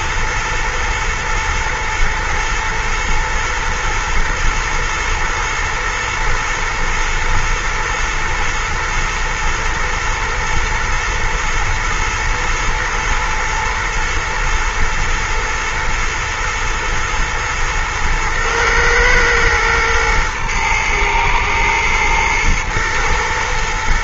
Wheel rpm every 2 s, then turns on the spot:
120, 120, 110, 120, 110, 110, 110, 110, 120, 120, 110, 120.
none